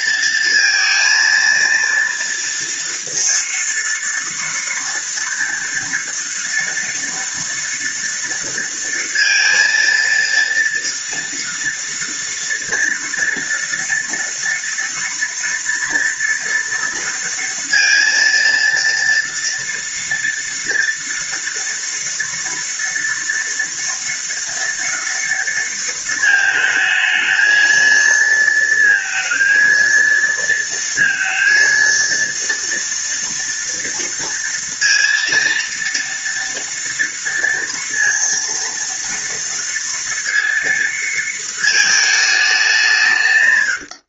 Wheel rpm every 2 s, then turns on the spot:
230, 230, 240, 230, 230, 230, 230, 230, 230, 230, 230, 230, 230, 220, 230, 230, 230, 230, 230, 230, 230, 150.
none